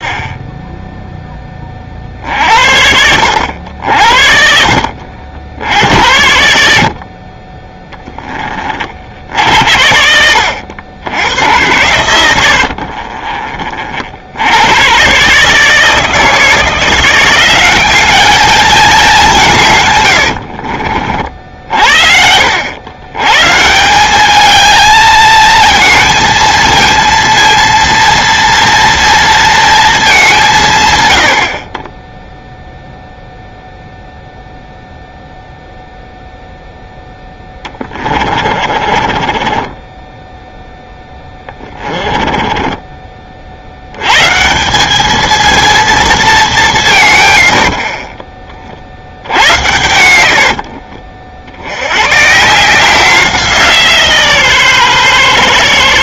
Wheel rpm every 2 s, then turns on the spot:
0, 70, 60, 60, 40, 80, 50, 100, 170, 210, 50, 80, 220, 230, 230, 140, 0, 0, 0, 40, 10, 20, 200, 160, 50, 60, 160, 130.
12-14 38-42 50-52